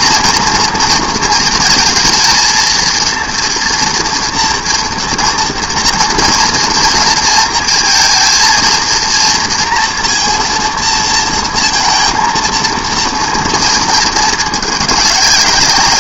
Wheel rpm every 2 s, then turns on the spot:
230, 230, 230, 230, 230, 230, 230, 210.
none